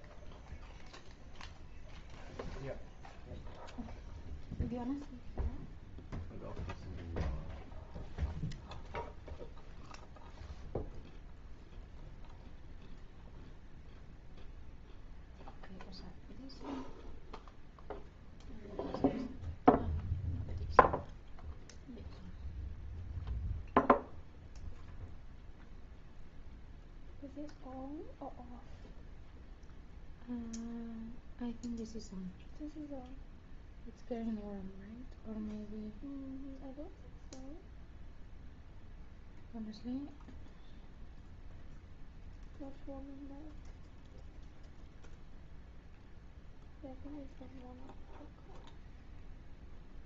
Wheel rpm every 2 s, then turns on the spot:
0, 0, 0, 0, 0, 0, 0, 0, 0, 0, 0, 0, 0, 0, 0, 0, 0, 0, 0, 0, 0, 0, 0, 0, 0.
none